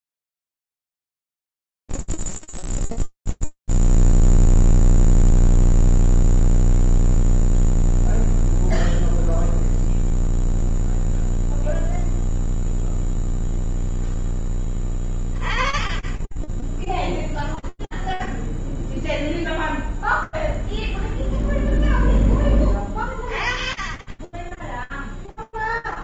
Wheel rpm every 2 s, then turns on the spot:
0, 0, 0, 0, 0, 0, 0, 20, 0, 0, 0, 20, 0.
none